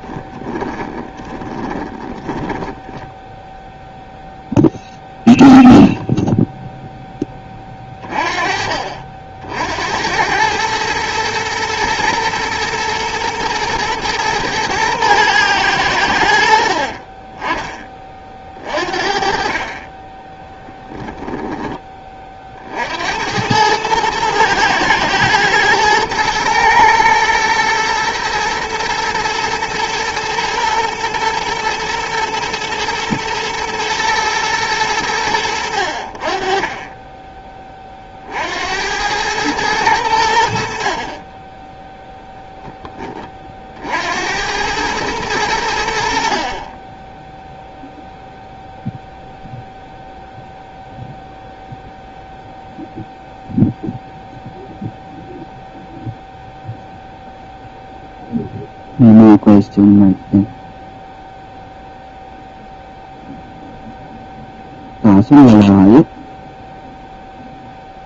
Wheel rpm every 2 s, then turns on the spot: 10, 10, 0, 0, 40, 110, 120, 120, 50, 40, 10, 60, 110, 110, 110, 120, 110, 110, 30, 80, 50, 10, 100, 30, 0, 0, 0, 0, 0, 0, 0, 0, 0, 0.
0-4 16-18 20-22